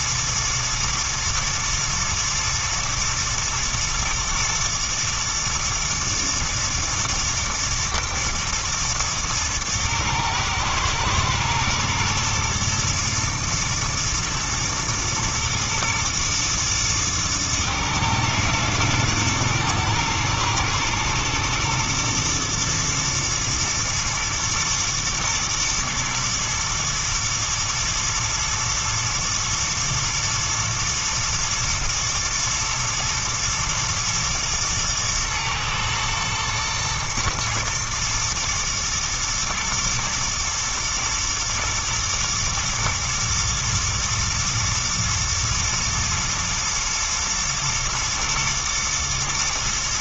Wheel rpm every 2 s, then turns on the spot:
110, 110, 110, 120, 110, 110, 120, 120, 110, 110, 110, 110, 120, 110, 110, 110, 110, 110, 110, 110, 110, 110, 120, 120, 120.
none